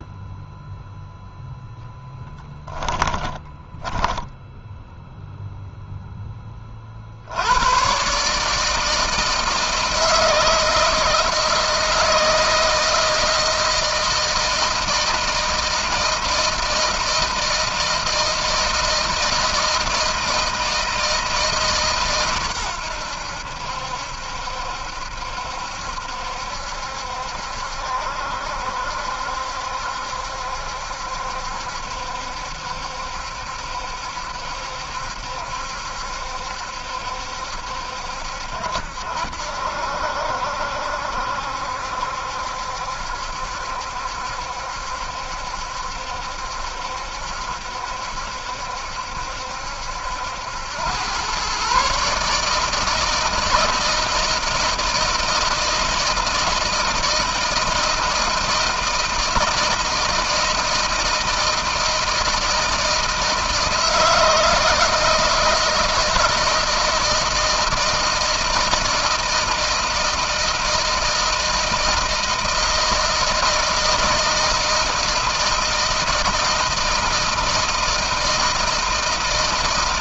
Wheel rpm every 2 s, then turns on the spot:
0, 10, 10, 10, 140, 160, 160, 160, 160, 160, 160, 130, 70, 70, 70, 70, 70, 70, 70, 70, 70, 70, 70, 70, 70, 80, 150, 160, 160, 160, 160, 160, 160, 160, 160, 160, 160, 160, 170, 160.
2-6